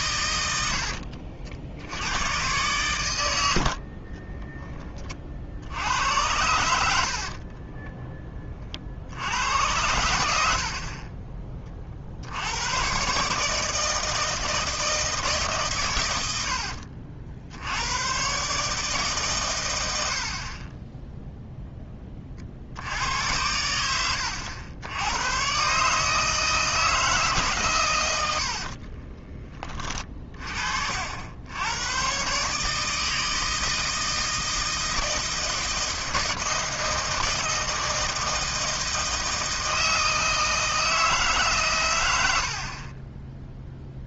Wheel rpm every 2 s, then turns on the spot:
70, 110, 20, 70, 50, 40, 110, 160, 70, 150, 10, 80, 100, 160, 40, 60, 150, 160, 160, 160, 160, 40.
0-2 28-30